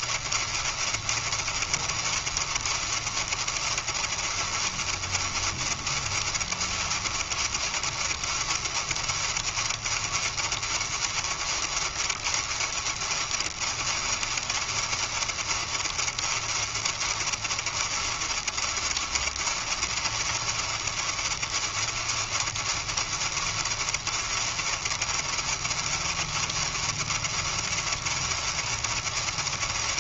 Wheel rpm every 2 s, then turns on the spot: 110, 110, 110, 110, 110, 110, 110, 110, 110, 110, 110, 110, 110, 110, 110.
none